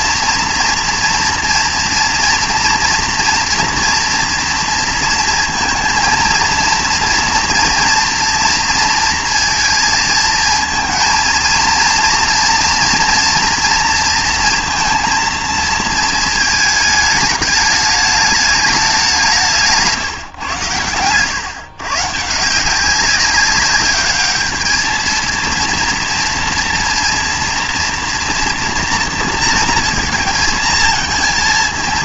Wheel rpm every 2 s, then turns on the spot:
230, 230, 230, 230, 230, 230, 230, 230, 220, 210, 120, 170, 210, 230, 230, 220.
none